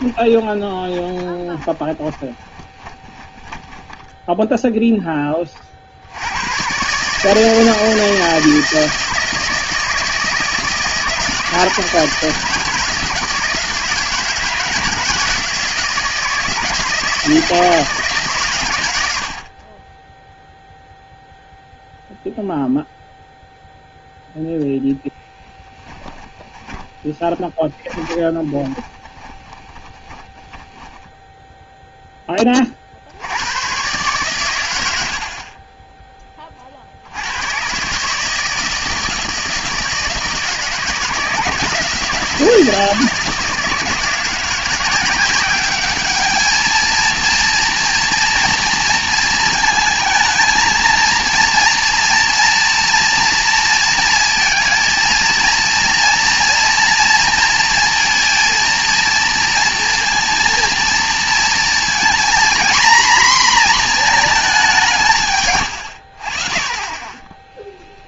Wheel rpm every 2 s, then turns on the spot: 20, 20, 0, 110, 160, 160, 160, 160, 160, 130, 0, 0, 0, 10, 20, 20, 30, 110, 30, 160, 160, 160, 180, 230, 230, 220, 230, 230, 230, 230, 230, 240, 200, 30.
0-4 26-32